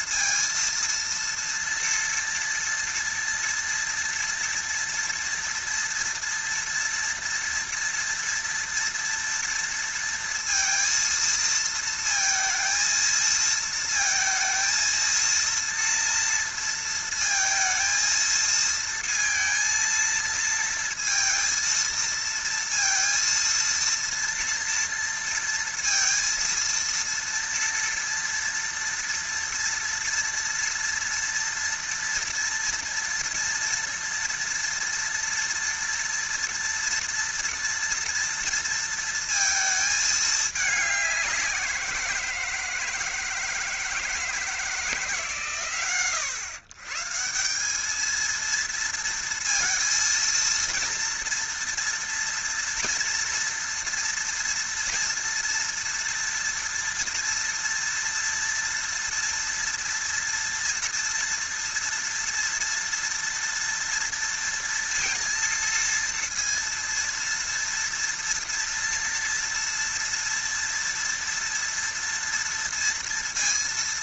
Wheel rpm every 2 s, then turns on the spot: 230, 230, 230, 230, 230, 230, 230, 230, 230, 230, 230, 230, 230, 230, 230, 230, 230, 230, 230, 230, 200, 160, 150, 130, 230, 230, 230, 230, 230, 230, 230, 230, 230, 230, 230, 230, 230.
none